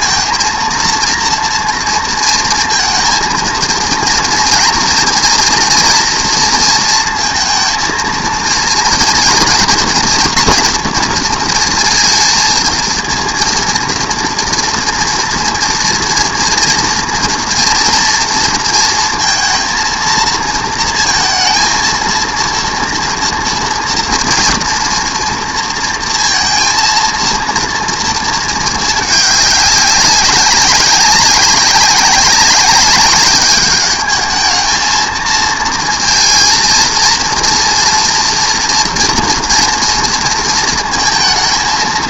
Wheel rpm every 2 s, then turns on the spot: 230, 230, 240, 230, 230, 230, 230, 230, 230, 230, 230, 230, 230, 230, 220, 190, 190, 220, 230, 230, 220.
none